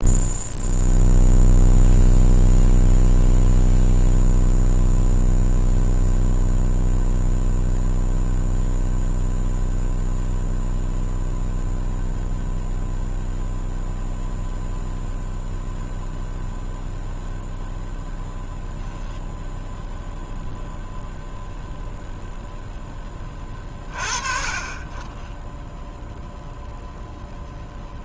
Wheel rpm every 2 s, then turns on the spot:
0, 0, 0, 0, 0, 0, 0, 0, 0, 0, 0, 0, 30, 0.
none